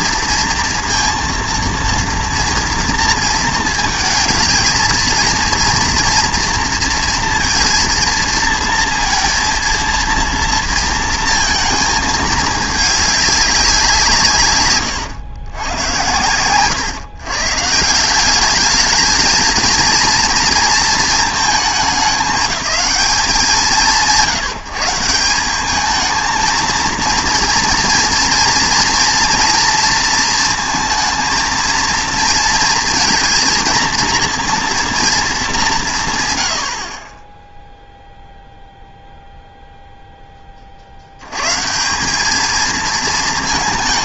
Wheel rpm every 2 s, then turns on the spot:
230, 230, 230, 230, 230, 230, 210, 120, 120, 210, 230, 210, 160, 230, 240, 230, 230, 230, 90, 0, 40, 220.
none